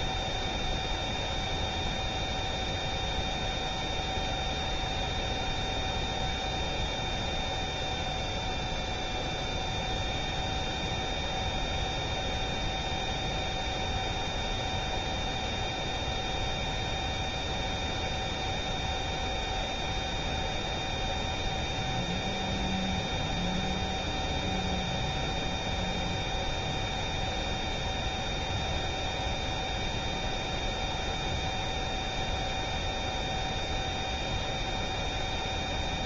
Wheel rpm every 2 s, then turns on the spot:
0, 0, 0, 0, 0, 0, 0, 0, 0, 0, 0, 0, 0, 0, 0, 0, 0, 0.
none